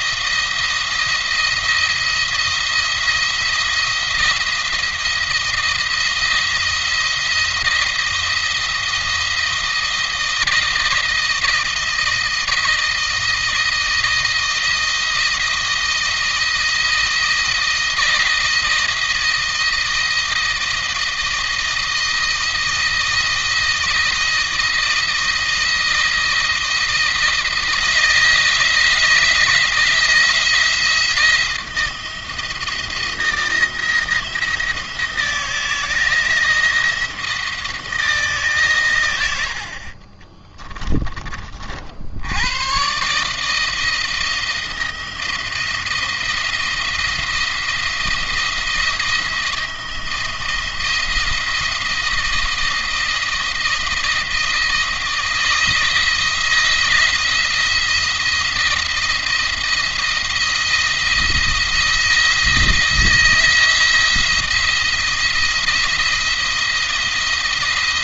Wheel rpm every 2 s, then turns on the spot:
170, 170, 170, 170, 170, 160, 160, 160, 160, 160, 160, 160, 170, 170, 160, 160, 170, 170, 170, 130, 20, 120, 170, 170, 160, 170, 170, 160, 160, 170, 170, 170, 170, 170.
none